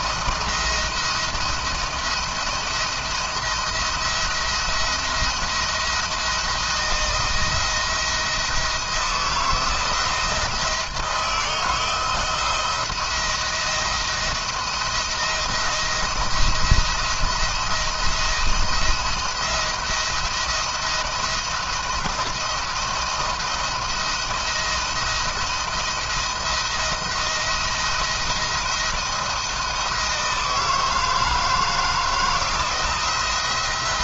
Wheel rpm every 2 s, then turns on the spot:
170, 170, 170, 170, 170, 170, 170, 170, 170, 170, 170, 160, 160, 170, 170, 160, 160.
none